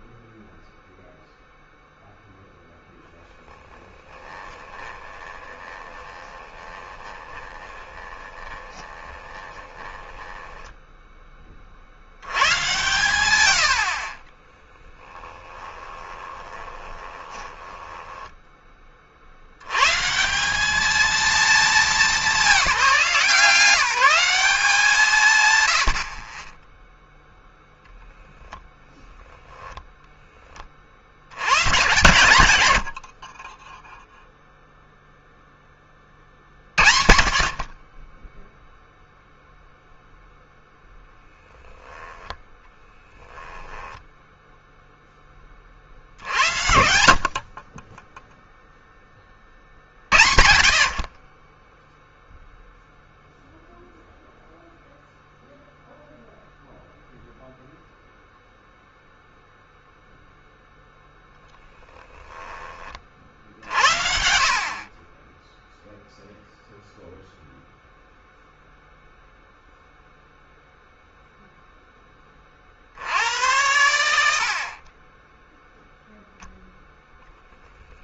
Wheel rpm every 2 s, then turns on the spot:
0, 0, 20, 20, 20, 10, 110, 10, 20, 20, 190, 200, 180, 20, 0, 30, 80, 0, 60, 0, 0, 0, 0, 70, 0, 60, 0, 0, 0, 0, 0, 20, 40, 0, 0, 0, 60, 50, 0.
4-12 14-18